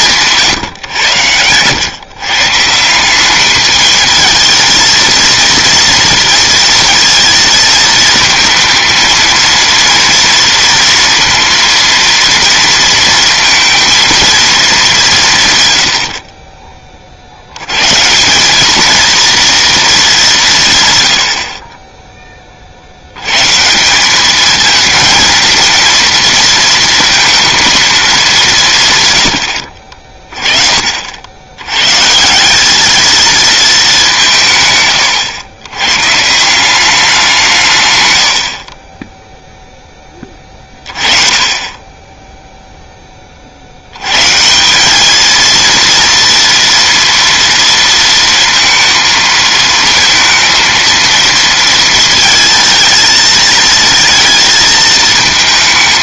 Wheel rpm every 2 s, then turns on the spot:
140, 150, 230, 230, 230, 230, 230, 210, 30, 210, 150, 70, 220, 230, 170, 40, 210, 110, 190, 30, 30, 20, 210, 230, 230, 230, 220, 220.
none